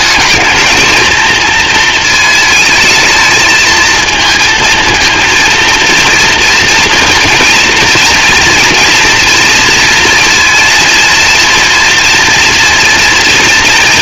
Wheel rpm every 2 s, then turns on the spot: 220, 220, 230, 230, 230, 230, 230.
none